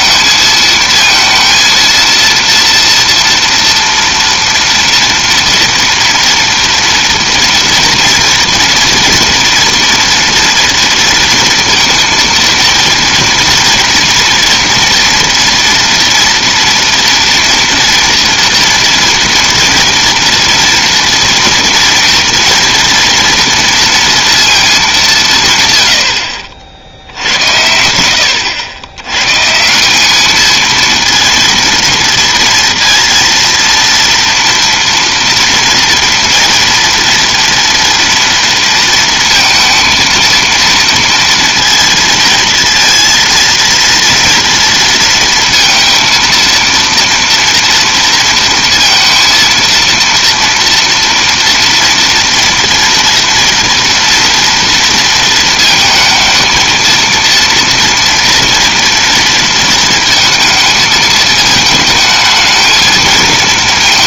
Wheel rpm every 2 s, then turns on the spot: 230, 230, 230, 230, 230, 230, 230, 230, 230, 230, 240, 230, 210, 60, 90, 220, 230, 230, 230, 230, 230, 230, 230, 230, 230, 230, 230, 230, 230, 230, 220, 220.
none